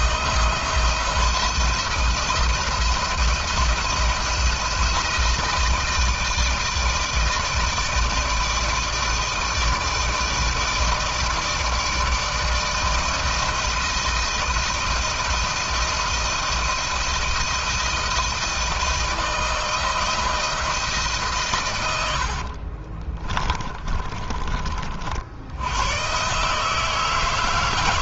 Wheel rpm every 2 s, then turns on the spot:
170, 170, 170, 160, 160, 160, 160, 170, 170, 170, 160, 40, 40, 150.
22-24